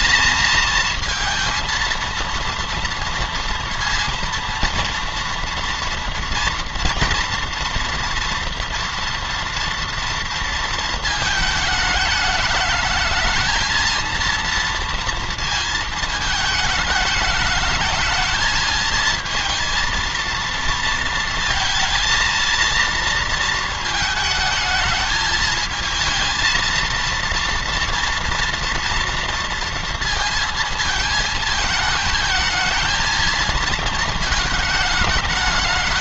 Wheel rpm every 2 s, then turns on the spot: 230, 230, 230, 240, 240, 220, 220, 230, 210, 220, 230, 230, 220, 230, 230, 220, 220, 220.
none